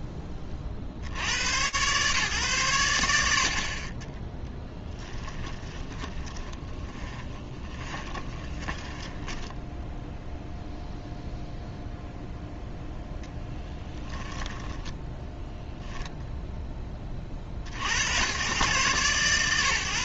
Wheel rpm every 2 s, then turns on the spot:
40, 60, 10, 20, 20, 0, 0, 10, 30, 120.
4-10 14-16